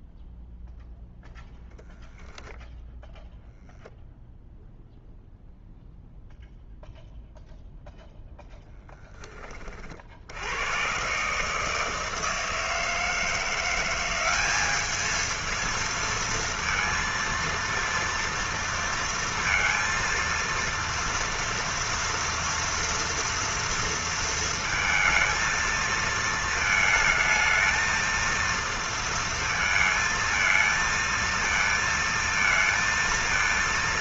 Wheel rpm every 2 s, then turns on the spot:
0, 0, 0, 0, 0, 80, 160, 190, 230, 230, 230, 230, 230, 220, 230, 220, 230.
none